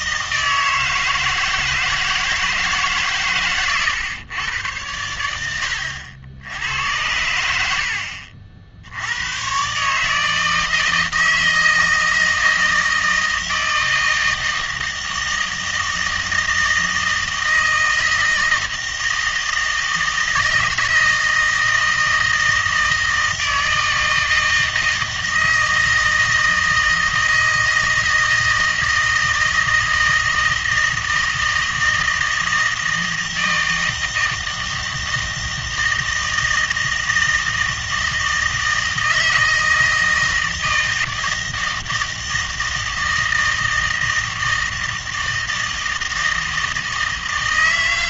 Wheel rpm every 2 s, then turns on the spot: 160, 150, 110, 90, 60, 160, 160, 160, 160, 160, 160, 160, 160, 160, 160, 160, 160, 160, 160, 160, 160, 160, 160, 160.
none